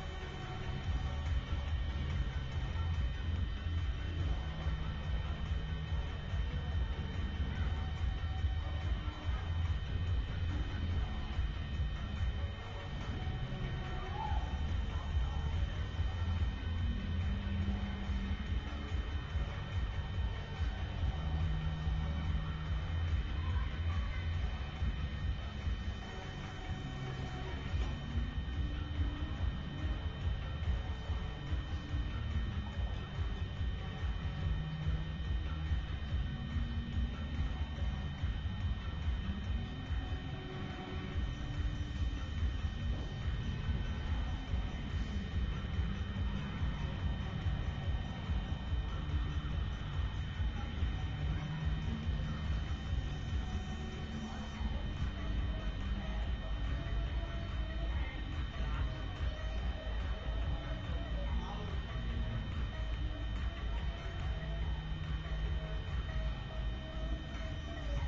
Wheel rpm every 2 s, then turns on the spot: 0, 0, 0, 0, 0, 0, 0, 0, 0, 0, 0, 0, 0, 0, 0, 0, 0, 0, 0, 0, 0, 0, 0, 0, 0, 0, 0, 0, 0, 0, 0, 0, 0, 0.
none